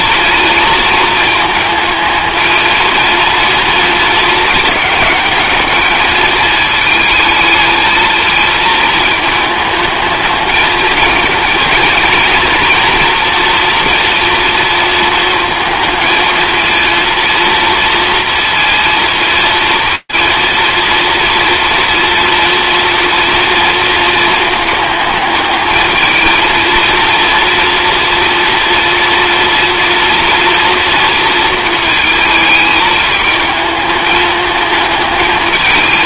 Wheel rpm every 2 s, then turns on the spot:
220, 220, 210, 220, 220, 220, 230, 230, 230, 230, 230, 230, 210, 230, 230, 230, 220, 220.
none